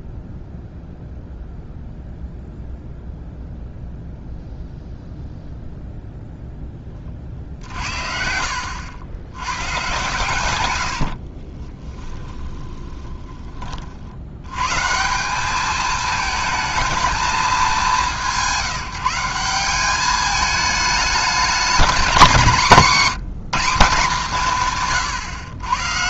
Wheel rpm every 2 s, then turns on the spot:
0, 0, 0, 10, 70, 100, 20, 130, 220, 180, 210, 180, 160.
8-10 12-14